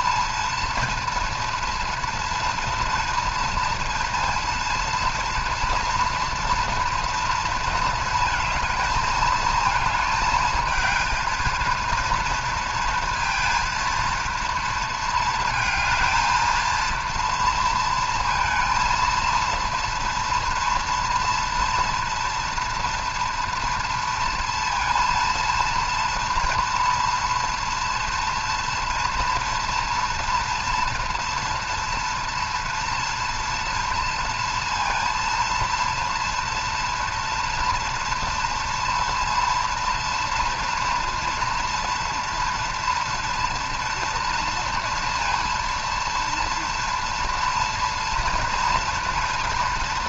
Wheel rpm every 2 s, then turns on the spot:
230, 230, 230, 240, 230, 220, 230, 230, 230, 230, 230, 230, 230, 230, 230, 230, 230, 230, 230, 230, 230, 230, 230, 230, 230.
none